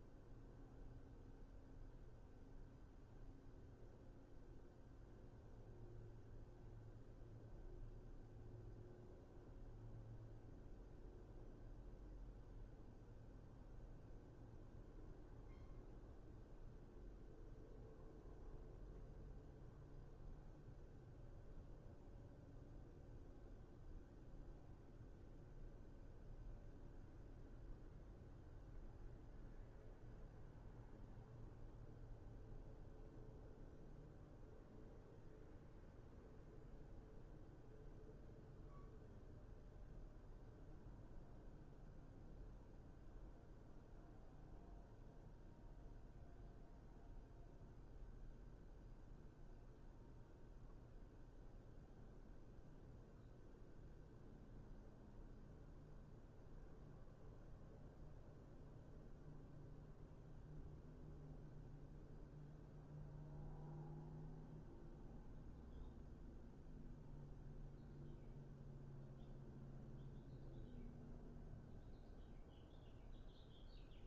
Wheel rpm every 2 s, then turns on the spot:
0, 0, 0, 0, 0, 0, 0, 0, 0, 0, 0, 0, 0, 0, 0, 0, 0, 0, 0, 0, 0, 0, 0, 0, 0, 0, 0, 0, 0, 0, 0, 0, 0, 0, 0, 0, 0.
none